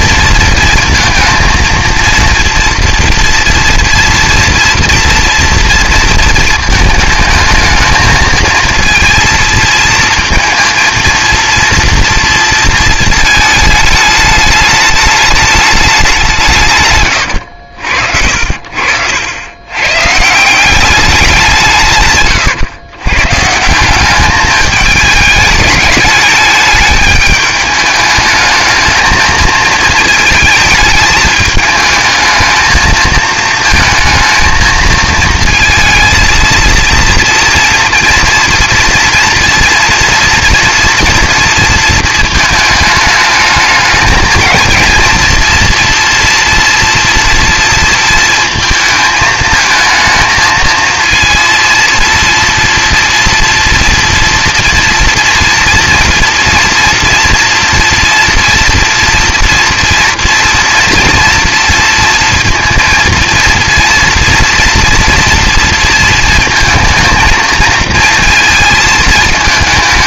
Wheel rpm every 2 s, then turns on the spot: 230, 230, 230, 220, 230, 230, 230, 210, 150, 70, 180, 120, 210, 210, 220, 220, 220, 220, 230, 230, 230, 220, 220, 230, 230, 220, 230, 230, 230, 230, 240, 230, 230, 230, 220.
18-20